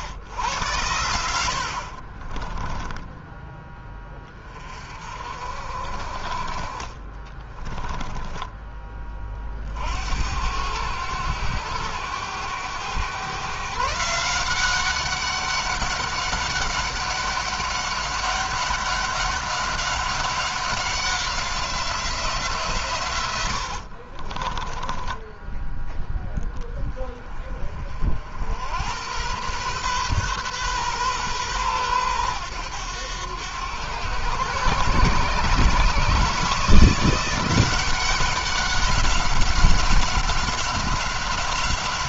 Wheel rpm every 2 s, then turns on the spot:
100, 20, 40, 30, 20, 90, 110, 190, 200, 200, 190, 140, 20, 20, 90, 130, 100, 120, 160, 190, 190.
2-4 24-26